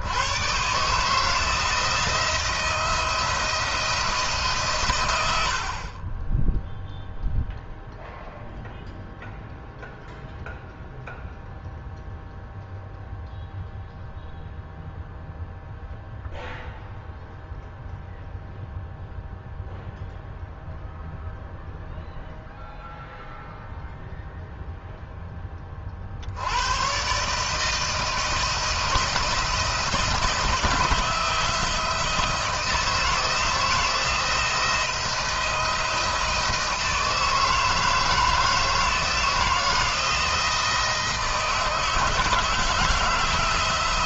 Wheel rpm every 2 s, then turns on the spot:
130, 170, 140, 10, 0, 0, 0, 0, 0, 0, 0, 0, 0, 110, 160, 160, 160, 160, 160, 170, 160, 160.
none